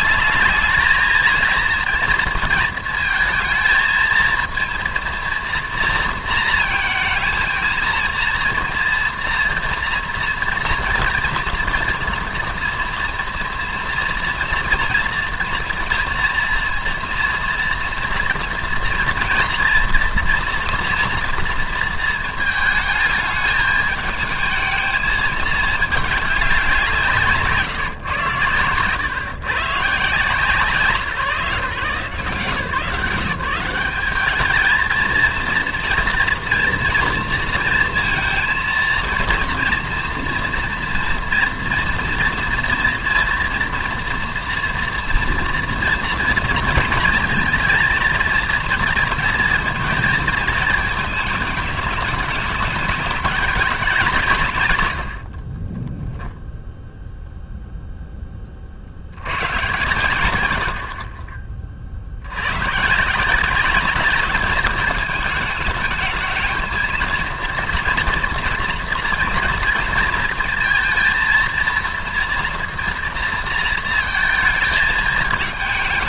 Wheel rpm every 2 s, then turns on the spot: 210, 230, 230, 230, 230, 240, 230, 230, 240, 230, 230, 220, 220, 190, 120, 150, 160, 220, 230, 230, 230, 230, 230, 230, 230, 220, 210, 140, 0, 40, 90, 110, 210, 220, 240, 230, 230, 230.
none